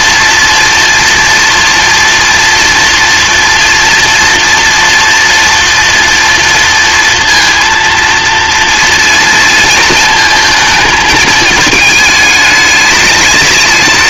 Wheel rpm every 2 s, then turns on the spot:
230, 230, 230, 230, 240, 220, 210.
none